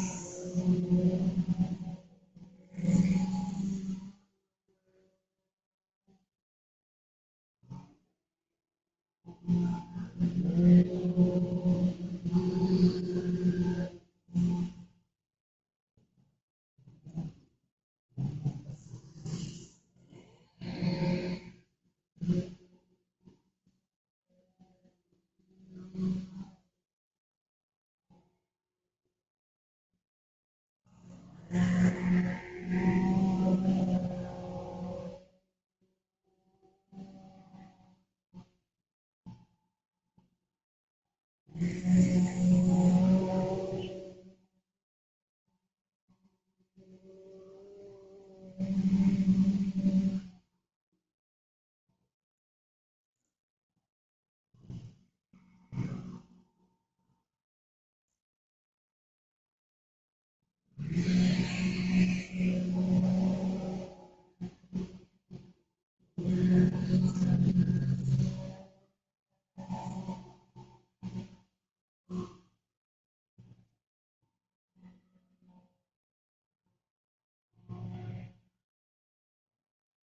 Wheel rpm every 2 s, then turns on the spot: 0, 0, 0, 0, 0, 0, 0, 0, 0, 0, 0, 0, 0, 0, 0, 0, 0, 0, 0, 0, 0, 0, 0, 0, 0, 0, 0, 0, 0, 0, 0, 0, 0, 0, 0, 0, 0, 0, 0, 0.
none